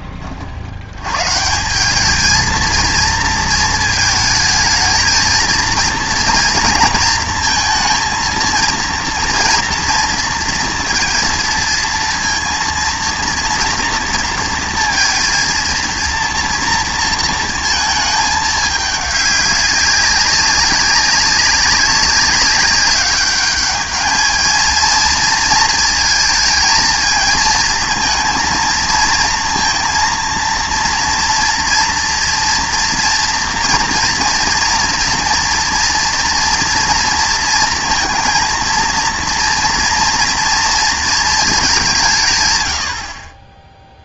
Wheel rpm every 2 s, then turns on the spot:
60, 220, 220, 230, 230, 230, 230, 230, 230, 210, 200, 200, 220, 220, 230, 230, 230, 230, 230, 230, 230, 120.
none